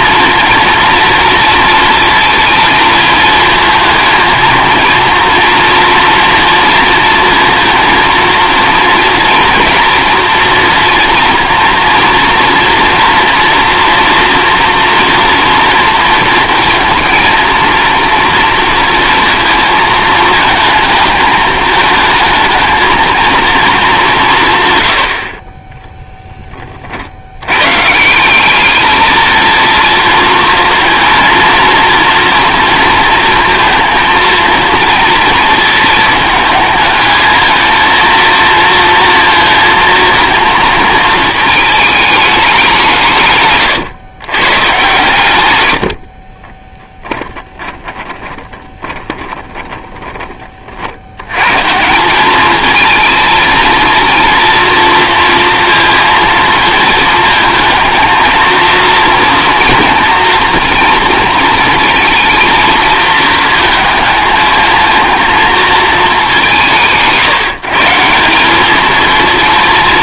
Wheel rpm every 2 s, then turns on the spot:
240, 230, 230, 230, 230, 230, 230, 230, 230, 230, 220, 220, 120, 40, 210, 230, 230, 230, 220, 230, 230, 190, 130, 20, 20, 70, 220, 230, 230, 230, 230, 230, 230, 170, 210.
46-50